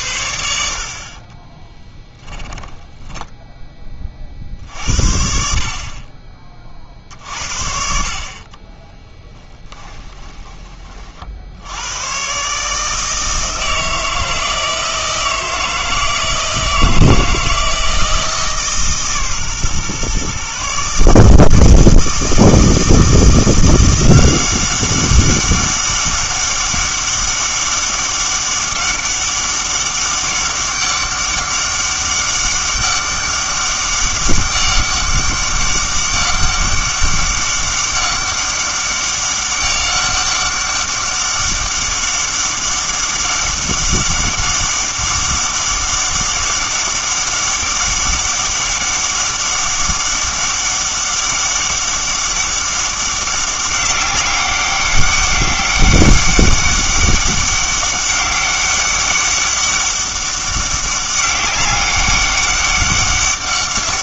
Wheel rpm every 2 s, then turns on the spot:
70, 10, 50, 40, 20, 30, 150, 160, 160, 150, 140, 160, 190, 200, 200, 200, 200, 200, 200, 200, 200, 200, 200, 200, 200, 200, 200, 200, 200, 200, 200, 200.
2-4 8-10